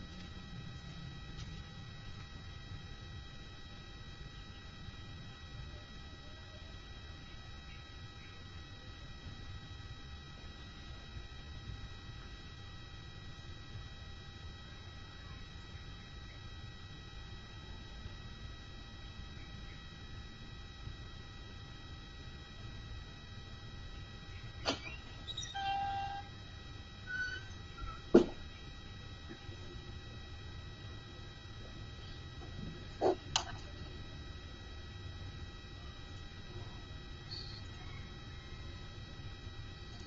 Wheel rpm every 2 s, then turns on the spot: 0, 0, 0, 0, 0, 0, 0, 0, 0, 0, 0, 0, 0, 0, 0, 0, 0, 0, 0, 0.
none